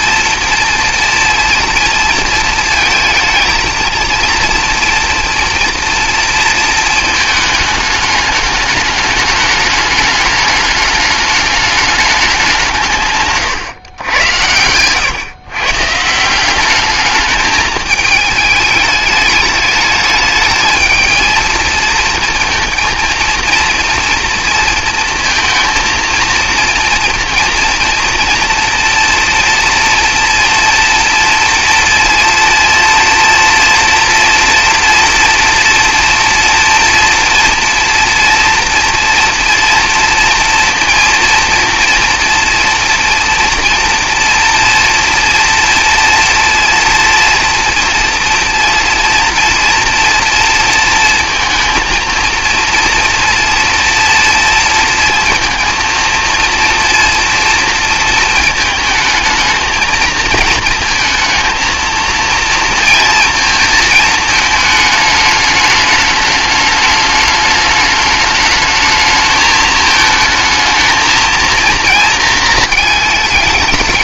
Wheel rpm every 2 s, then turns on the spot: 230, 220, 240, 230, 210, 210, 160, 110, 200, 210, 220, 230, 230, 230, 230, 230, 230, 230, 230, 240, 230, 240, 230, 230, 230, 230, 230, 230, 230, 220, 230, 230, 210, 210, 220, 220, 220.
none